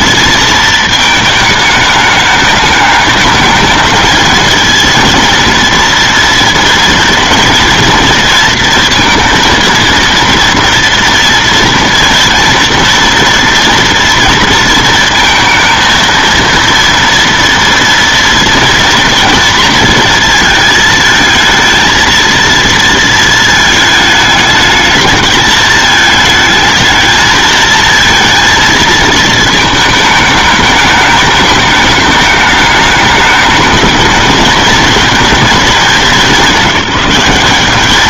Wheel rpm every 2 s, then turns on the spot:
220, 210, 220, 230, 230, 230, 230, 230, 230, 230, 220, 230, 210, 220, 230, 210, 210, 210, 190.
none